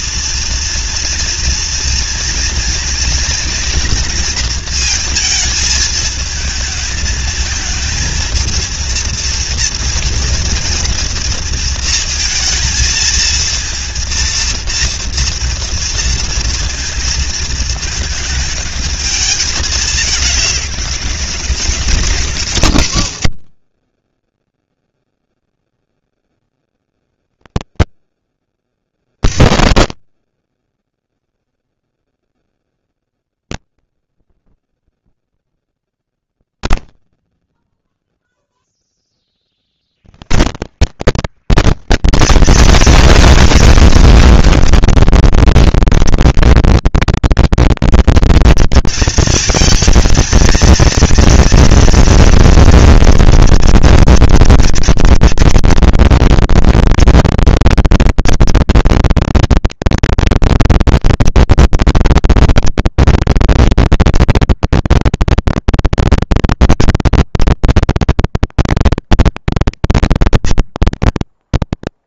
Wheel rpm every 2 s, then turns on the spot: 230, 230, 230, 220, 230, 230, 230, 230, 230, 220, 200, 160, 20, 110, 80, 60, 0, 0, 0, 0, 170, 230, 240, 230, 230, 230, 230, 230, 230, 230, 230, 230, 230, 220, 220, 230.
none